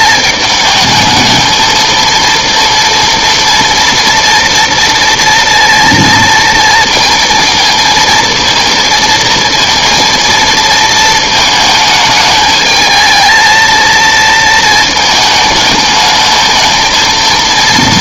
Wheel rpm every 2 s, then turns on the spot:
220, 230, 240, 230, 230, 220, 220, 230, 220.
none